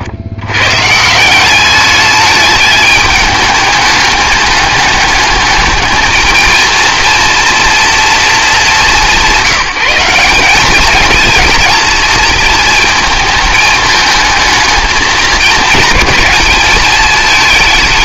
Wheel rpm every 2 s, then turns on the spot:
120, 210, 210, 230, 200, 210, 230, 220, 210.
none